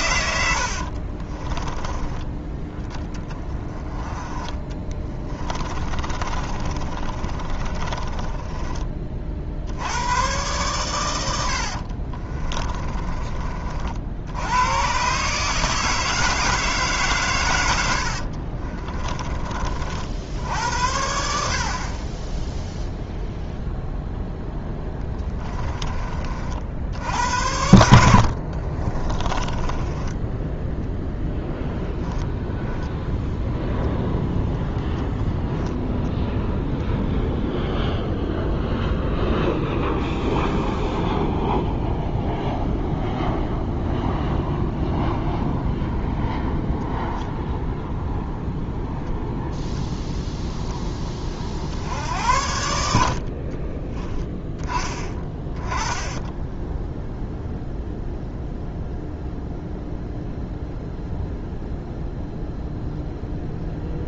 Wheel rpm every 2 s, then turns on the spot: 60, 10, 20, 30, 30, 120, 30, 110, 150, 30, 70, 0, 10, 60, 40, 10, 0, 0, 0, 0, 0, 0, 0, 0, 0, 10, 70, 20, 0, 0, 0, 0.
0-2 4-8 12-14 18-20 24-26 28-32